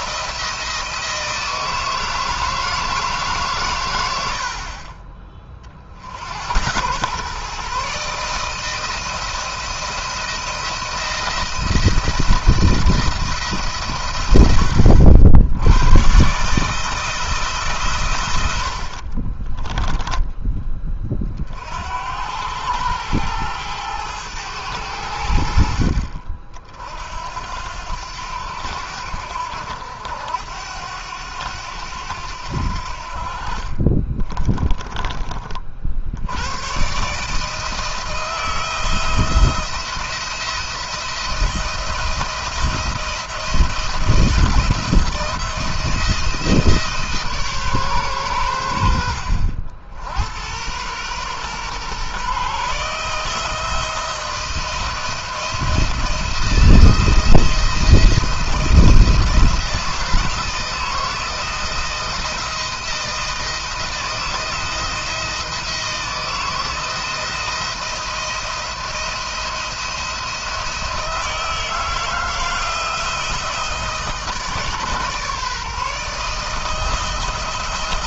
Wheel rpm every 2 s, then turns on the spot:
170, 160, 50, 100, 160, 170, 160, 100, 150, 80, 20, 100, 100, 50, 80, 90, 70, 20, 120, 170, 170, 170, 170, 160, 90, 100, 140, 160, 170, 170, 170, 170, 170, 160, 170, 160, 170, 150, 160.
18-20 34-36